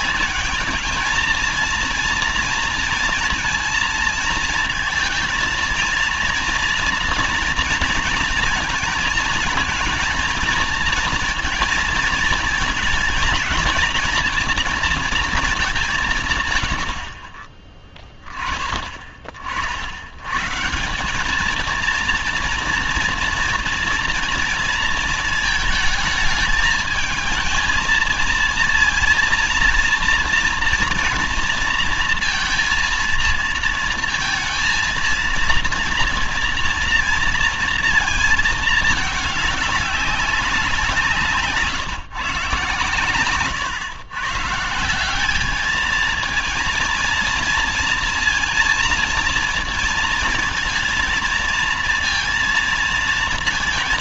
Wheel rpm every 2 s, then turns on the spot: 210, 230, 230, 230, 230, 220, 230, 230, 130, 20, 120, 230, 230, 210, 230, 230, 230, 230, 240, 220, 190, 130, 150, 220, 230, 220, 230.
none